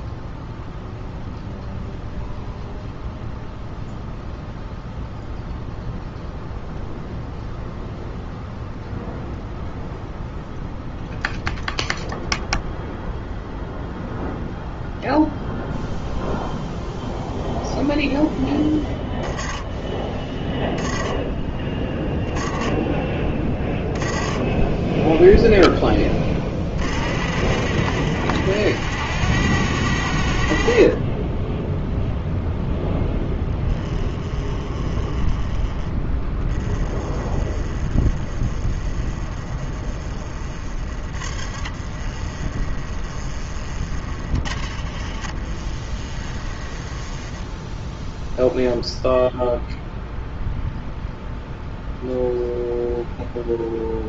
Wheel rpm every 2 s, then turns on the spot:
0, 0, 0, 0, 0, 0, 0, 0, 0, 10, 10, 20, 10, 50, 80, 30, 10, 20, 20, 20, 40, 20, 50, 10, 0, 0, 0.
30-36 40-46